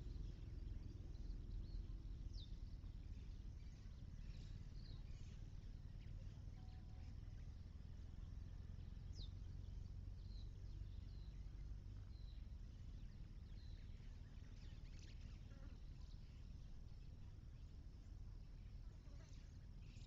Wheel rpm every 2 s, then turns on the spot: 0, 0, 0, 0, 0, 0, 0, 0, 0, 0.
none